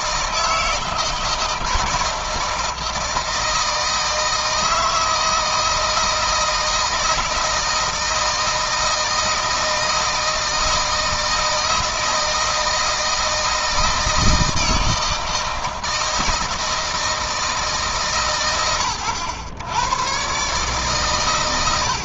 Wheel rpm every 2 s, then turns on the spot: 160, 160, 160, 160, 160, 160, 160, 160, 160, 110, 140.
none